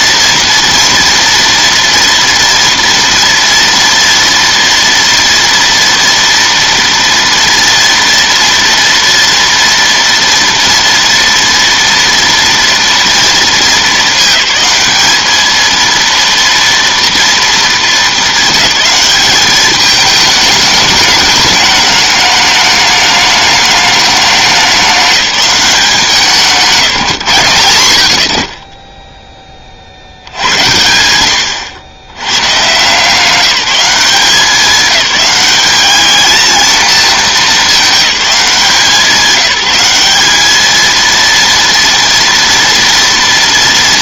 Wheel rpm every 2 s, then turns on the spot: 230, 230, 230, 230, 230, 230, 240, 210, 230, 220, 210, 210, 200, 180, 20, 90, 130, 200, 230, 180, 220, 230.
none